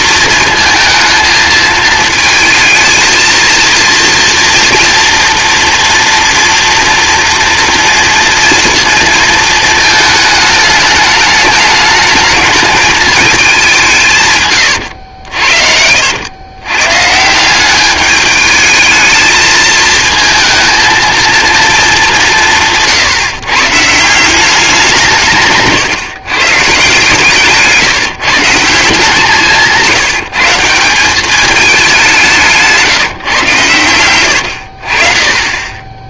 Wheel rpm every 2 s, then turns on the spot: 220, 220, 230, 230, 230, 210, 220, 90, 150, 220, 230, 150, 160, 150, 170, 190, 150, 40.
14-16